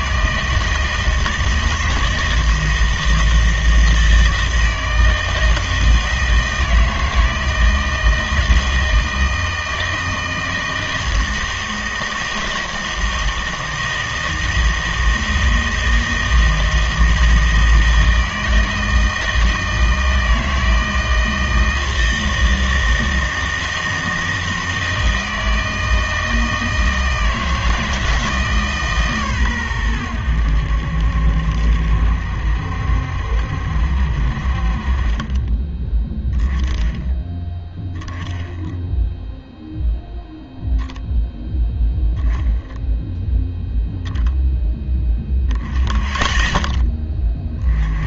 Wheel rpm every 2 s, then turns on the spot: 160, 160, 160, 160, 160, 160, 160, 160, 160, 160, 160, 160, 160, 160, 150, 80, 70, 50, 10, 10, 0, 0, 0, 10.
none